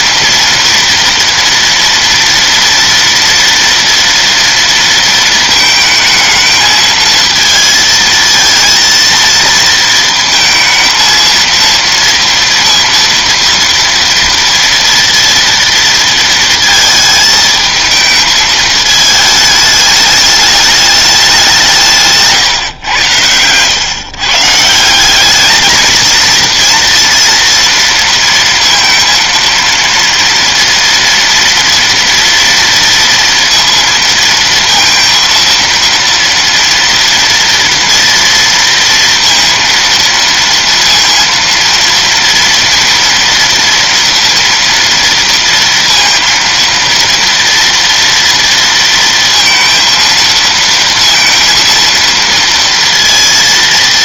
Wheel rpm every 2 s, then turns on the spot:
230, 230, 230, 220, 230, 230, 230, 230, 230, 220, 210, 130, 170, 230, 230, 230, 230, 230, 230, 230, 230, 230, 230, 230, 230, 230, 230.
none